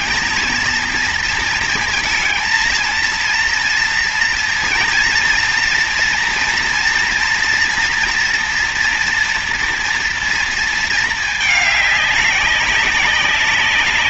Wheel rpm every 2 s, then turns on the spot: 230, 230, 230, 230, 230, 230, 190.
none